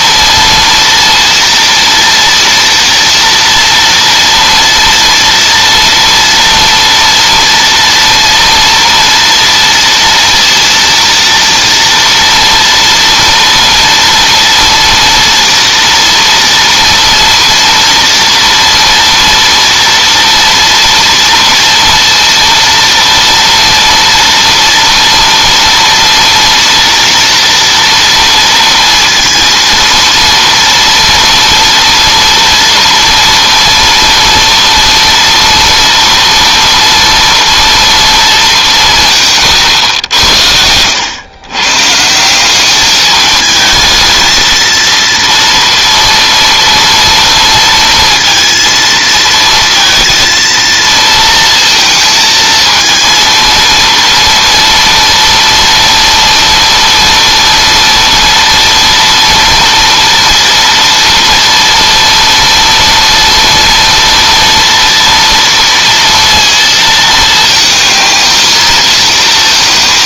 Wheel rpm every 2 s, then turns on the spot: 230, 230, 230, 240, 240, 230, 240, 230, 230, 230, 230, 230, 230, 230, 230, 230, 230, 230, 230, 230, 90, 160, 220, 230, 230, 230, 220, 230, 230, 230, 230, 230, 230, 230, 220.
none